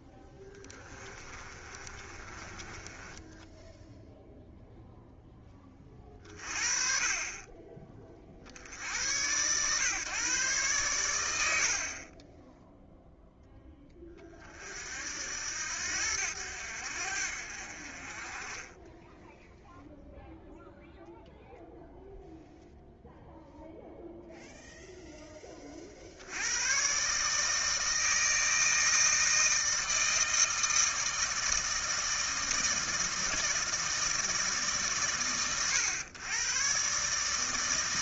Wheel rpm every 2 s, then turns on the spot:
20, 20, 0, 40, 80, 120, 0, 50, 80, 20, 0, 0, 0, 100, 160, 160, 160, 150, 120.
0-4